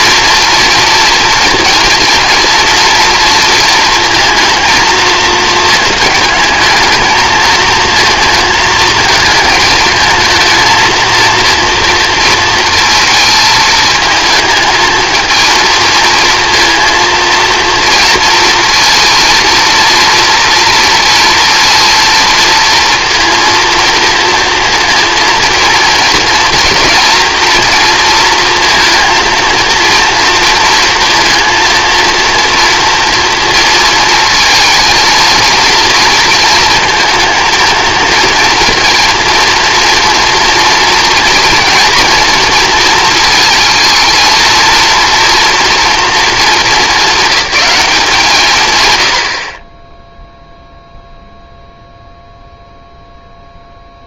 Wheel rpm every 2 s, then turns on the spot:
230, 230, 230, 220, 220, 230, 230, 220, 230, 230, 230, 230, 230, 230, 230, 230, 230, 230, 230, 230, 230, 230, 230, 220, 140, 0, 0.
none